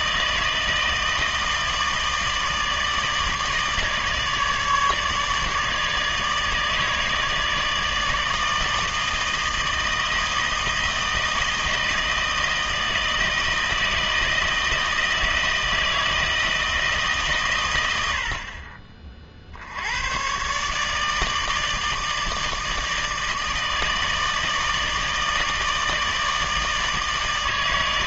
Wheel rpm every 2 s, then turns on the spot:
160, 160, 150, 150, 160, 160, 160, 160, 160, 40, 140, 160, 160, 160.
none